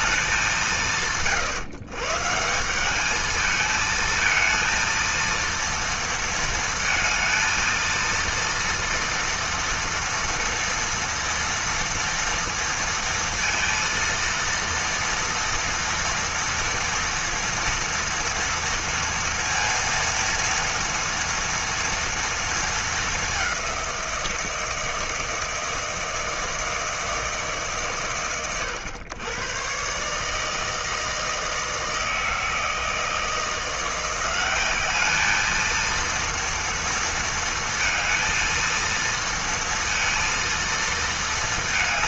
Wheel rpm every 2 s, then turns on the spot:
160, 200, 230, 230, 230, 230, 230, 230, 230, 230, 230, 220, 160, 160, 90, 160, 160, 200, 230, 230, 230.
none